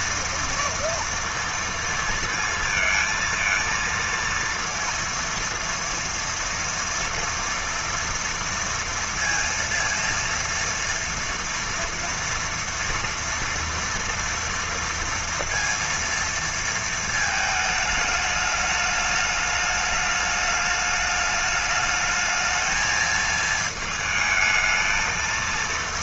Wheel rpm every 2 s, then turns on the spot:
230, 230, 230, 230, 230, 230, 230, 230, 230, 210, 210, 220, 220.
none